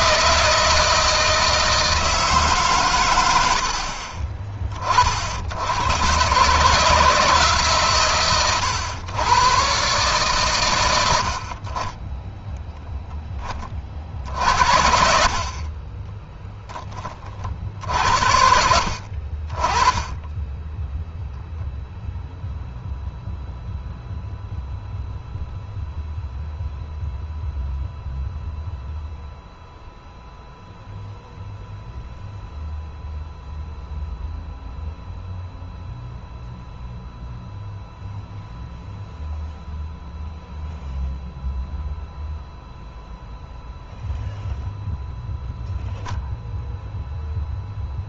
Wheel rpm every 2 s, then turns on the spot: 160, 130, 40, 160, 120, 100, 0, 70, 10, 60, 10, 0, 0, 0, 0, 0, 0, 0, 0, 0, 0, 0, 0, 0.
none